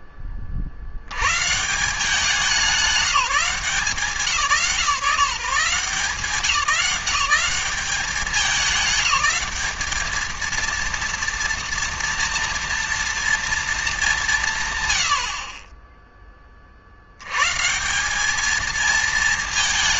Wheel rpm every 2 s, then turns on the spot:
80, 190, 170, 190, 190, 230, 230, 110, 70, 220.
none